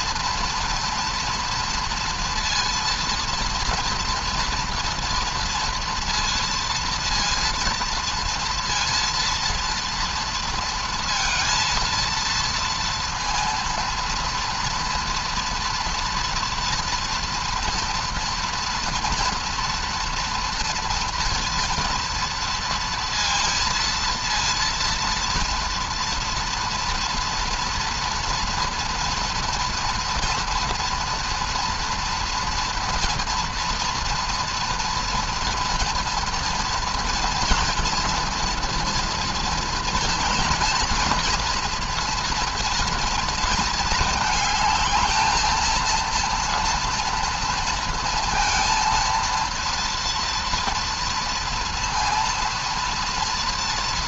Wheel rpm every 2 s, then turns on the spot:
230, 230, 230, 230, 230, 230, 230, 230, 230, 240, 230, 230, 230, 240, 230, 230, 230, 230, 230, 240, 230, 230, 220, 230, 230, 230, 230.
none